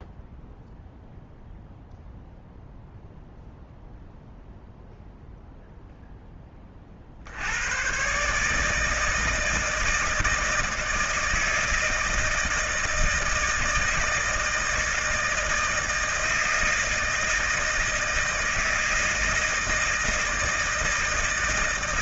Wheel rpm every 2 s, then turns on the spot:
0, 0, 0, 20, 150, 160, 160, 160, 160, 160, 160.
none